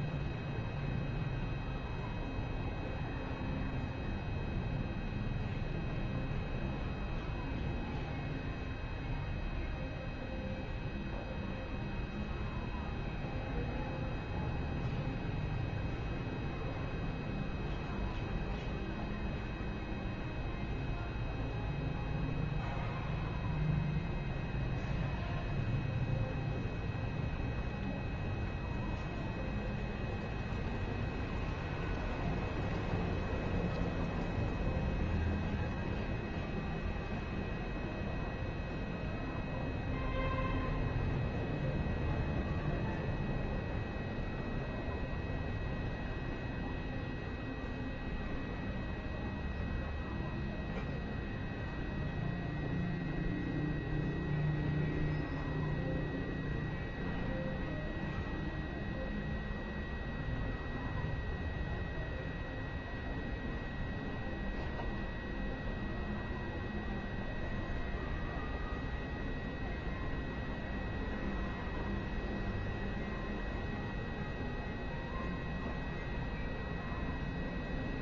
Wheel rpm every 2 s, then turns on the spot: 0, 0, 0, 0, 0, 0, 0, 0, 0, 0, 0, 0, 0, 0, 0, 0, 0, 0, 0, 0, 0, 0, 0, 0, 0, 0, 0, 0, 0, 0, 0, 0, 0, 0, 0, 0, 0, 0, 0.
none